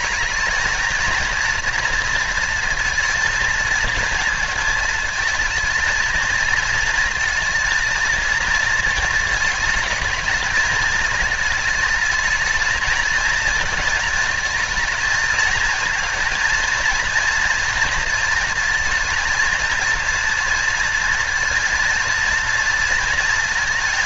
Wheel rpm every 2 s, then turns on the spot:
220, 230, 230, 230, 230, 230, 220, 220, 230, 230, 230, 230.
none